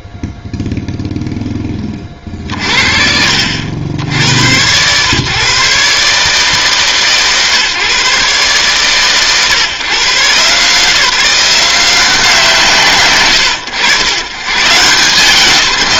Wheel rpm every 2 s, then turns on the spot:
0, 20, 100, 140, 140, 140, 170, 110.
none